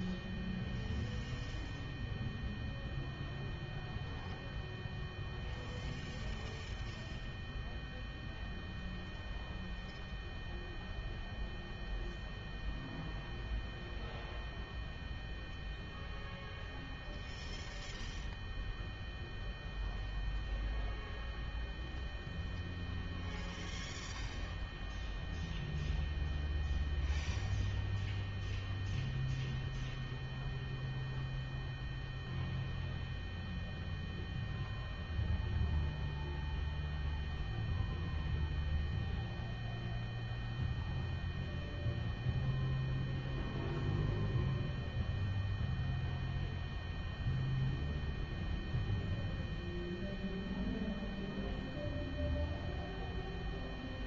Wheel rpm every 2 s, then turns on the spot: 0, 0, 0, 0, 0, 0, 0, 0, 0, 0, 0, 0, 0, 0, 0, 0, 0, 0, 0, 0, 0, 0, 0, 0, 0, 0, 0.
none